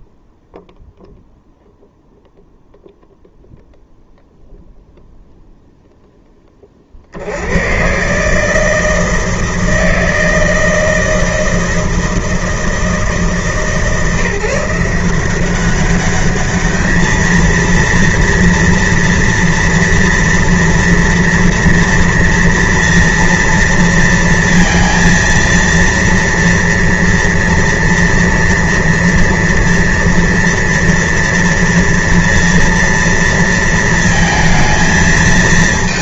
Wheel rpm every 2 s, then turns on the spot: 0, 0, 0, 20, 150, 160, 160, 150, 210, 230, 230, 230, 230, 240, 230, 230, 230, 230.
none